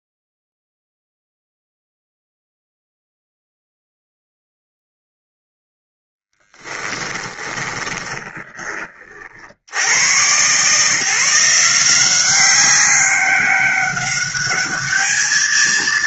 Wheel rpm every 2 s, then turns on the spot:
0, 0, 0, 20, 30, 150, 200, 210.
6-8